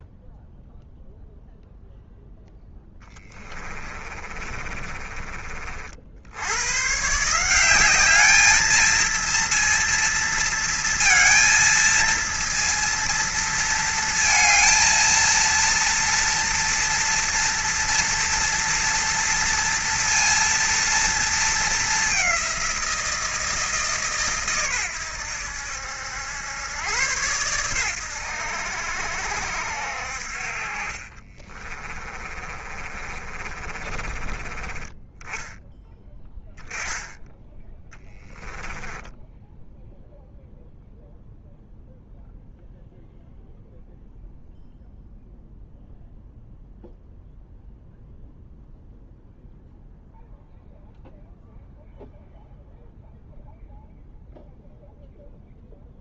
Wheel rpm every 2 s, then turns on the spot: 0, 10, 30, 110, 220, 230, 230, 230, 230, 230, 230, 180, 110, 110, 80, 40, 30, 20, 10, 10, 0, 0, 0, 0, 0, 0, 0, 0.
2-6 32-34 38-40